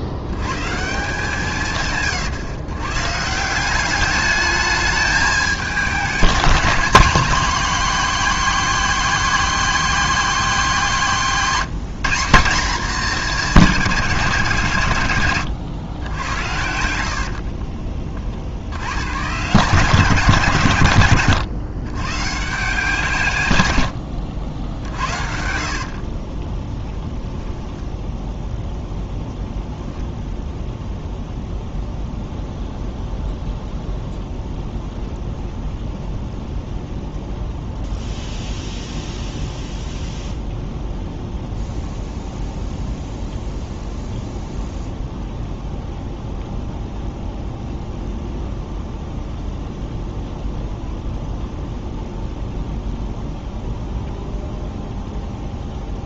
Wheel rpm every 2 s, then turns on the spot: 160, 120, 210, 210, 240, 210, 210, 140, 80, 120, 130, 150, 60, 10, 0, 0, 0, 0, 0, 0, 0, 0, 0, 0, 0, 0, 0, 0.
16-18 26-28